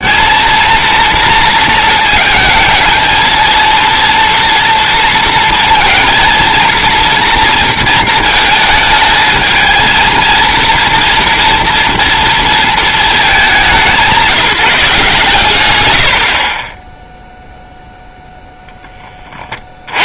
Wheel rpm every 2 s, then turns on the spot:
230, 220, 230, 230, 220, 230, 230, 180, 20, 0.
none